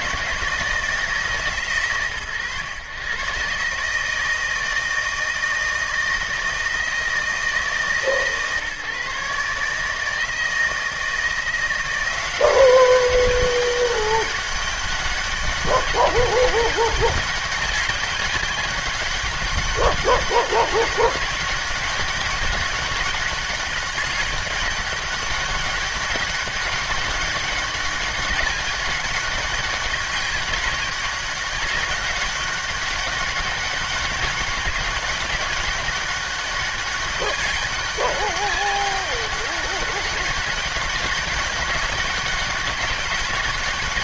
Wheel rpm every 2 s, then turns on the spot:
160, 130, 160, 160, 150, 160, 190, 200, 200, 190, 200, 200, 200, 200, 200, 200, 200, 200, 200, 200, 200, 200.
none